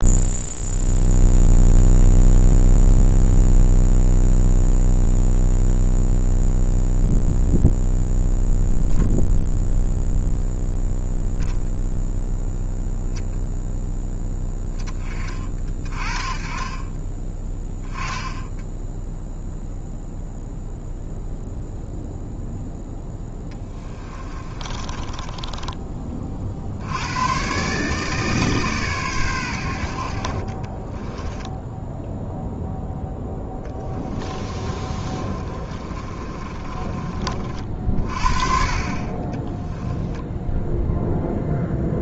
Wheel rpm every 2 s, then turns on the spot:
0, 0, 0, 0, 0, 0, 0, 20, 20, 0, 0, 10, 30, 80, 130, 20, 0, 30, 30, 30, 0.
24-26 30-32 34-38